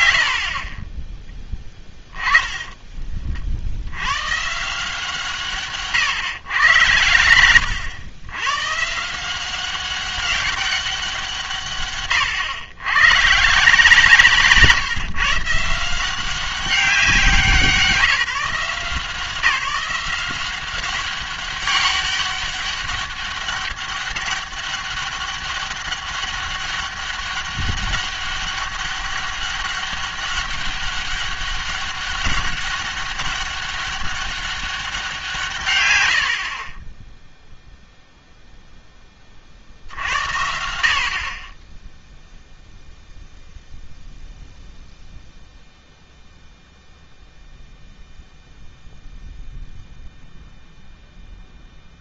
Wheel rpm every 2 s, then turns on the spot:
80, 20, 150, 130, 130, 200, 110, 150, 190, 160, 180, 200, 200, 200, 200, 200, 190, 200, 40, 0, 70, 0, 0, 0, 0, 0.
2-4 36-38